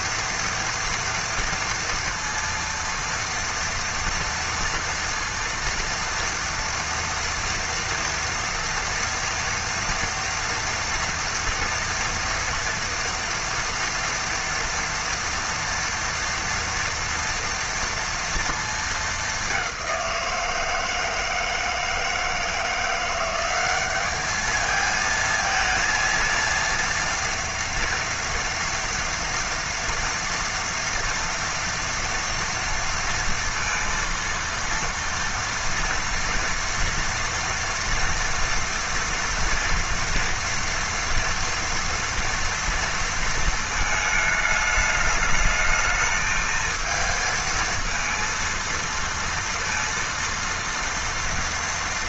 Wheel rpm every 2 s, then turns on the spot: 230, 230, 240, 240, 230, 230, 230, 240, 240, 230, 170, 160, 210, 230, 230, 230, 230, 230, 230, 230, 230, 230, 220, 220, 230, 230.
none